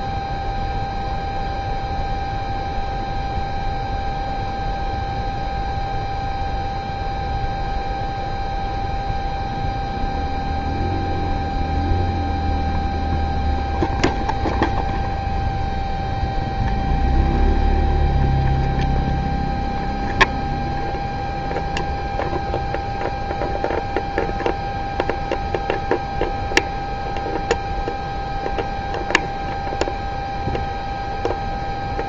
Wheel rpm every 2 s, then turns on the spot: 0, 0, 0, 0, 0, 0, 0, 0, 0, 0, 0, 0, 0, 0, 0, 0.
none